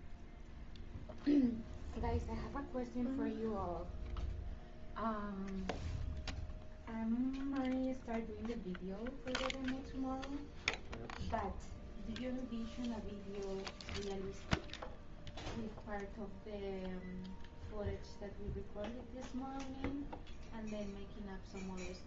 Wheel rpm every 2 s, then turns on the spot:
0, 0, 0, 0, 0, 0, 0, 0, 0, 0, 0.
none